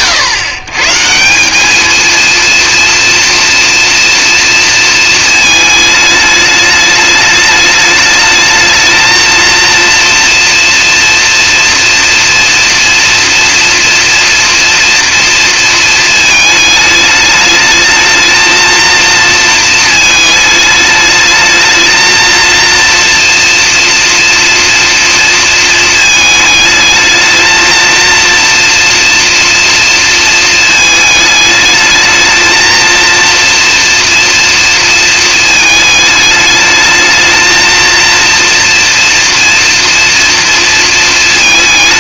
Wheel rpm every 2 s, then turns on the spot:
140, 230, 230, 210, 220, 230, 230, 230, 210, 230, 220, 230, 230, 220, 240, 220, 230, 230, 220, 230, 230.
none